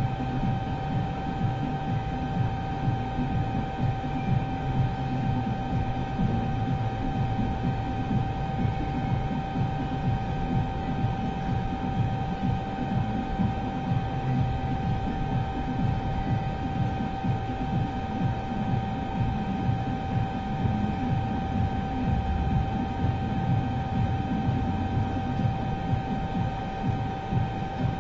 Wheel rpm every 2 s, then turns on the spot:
0, 0, 0, 0, 0, 0, 0, 0, 0, 0, 0, 0, 0, 0.
none